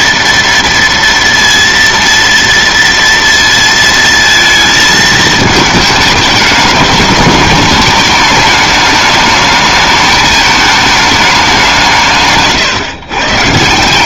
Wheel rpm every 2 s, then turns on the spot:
230, 230, 220, 210, 210, 210, 130.
none